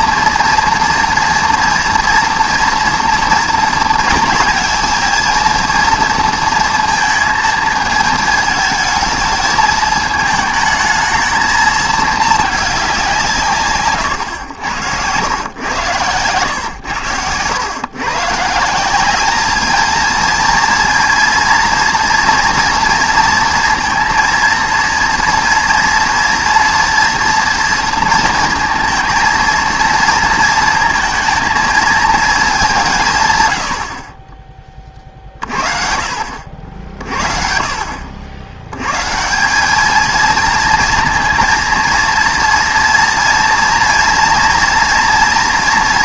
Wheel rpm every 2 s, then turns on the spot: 230, 230, 220, 230, 220, 220, 200, 100, 110, 170, 230, 230, 230, 240, 230, 230, 190, 20, 60, 100, 230, 230, 230.
none